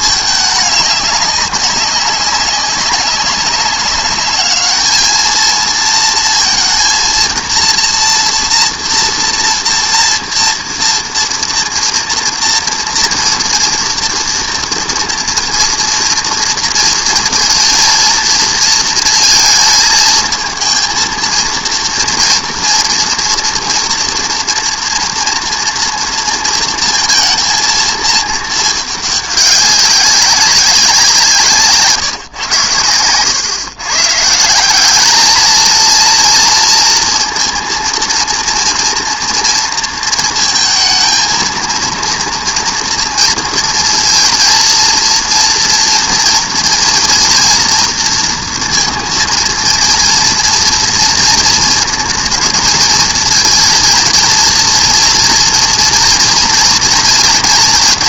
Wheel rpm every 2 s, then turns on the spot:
210, 200, 210, 230, 230, 230, 230, 230, 230, 230, 230, 230, 230, 230, 220, 190, 110, 190, 230, 230, 220, 230, 230, 240, 230, 230, 220, 230, 240.
none